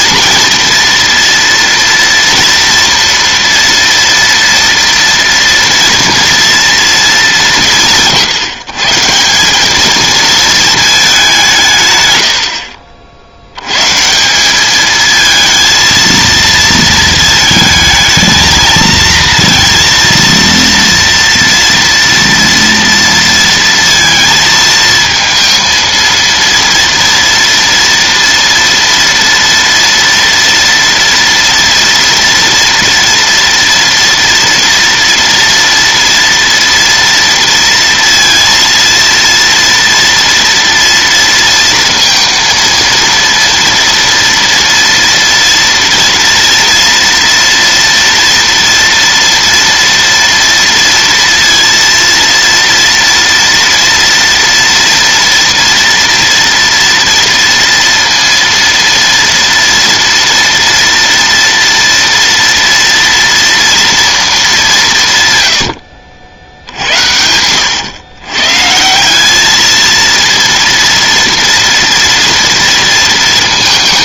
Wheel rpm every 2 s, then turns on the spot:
230, 230, 230, 230, 140, 220, 70, 200, 230, 220, 230, 230, 230, 230, 230, 230, 230, 230, 230, 230, 240, 230, 230, 230, 230, 230, 230, 230, 230, 230, 240, 240, 190, 70, 140, 230, 230.
none